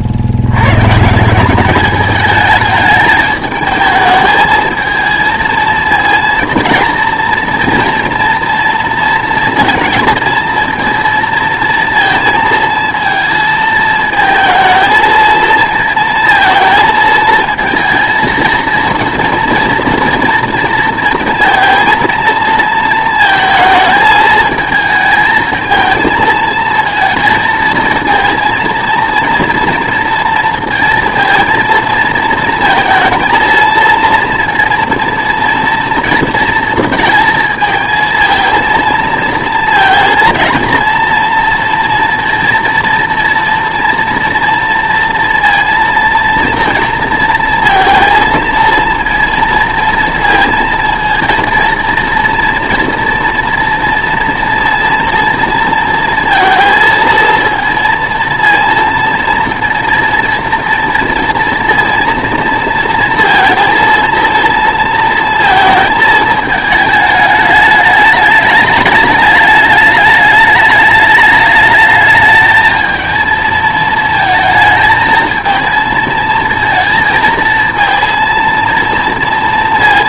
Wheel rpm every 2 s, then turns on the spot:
120, 210, 220, 230, 230, 230, 230, 220, 230, 220, 230, 220, 220, 220, 230, 230, 220, 230, 230, 230, 230, 230, 230, 230, 230, 230, 230, 230, 230, 230, 230, 230, 230, 220, 210, 210, 220, 220, 230, 230.
none